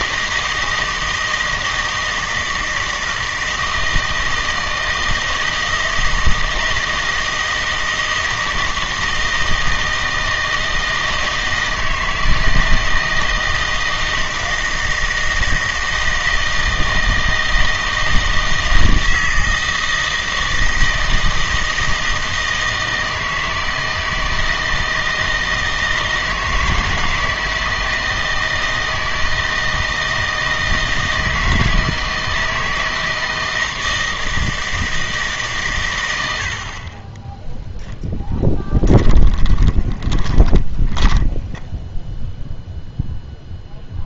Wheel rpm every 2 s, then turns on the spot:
160, 160, 160, 160, 160, 160, 160, 160, 160, 160, 160, 160, 160, 160, 160, 160, 160, 160, 70, 10, 10, 0.
40-42